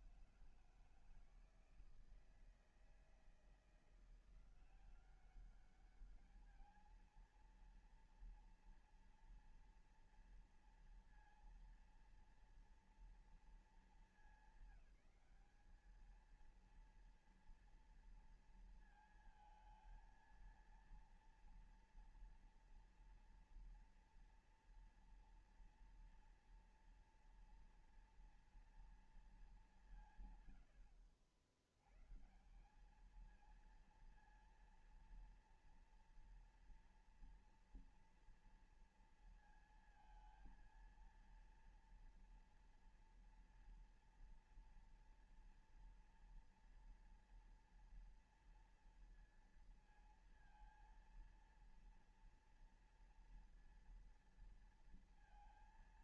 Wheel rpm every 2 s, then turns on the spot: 150, 160, 170, 210, 230, 230, 230, 220, 220, 230, 230, 230, 230, 240, 230, 130, 150, 230, 230, 230, 230, 230, 230, 230, 230, 230, 230, 230.
none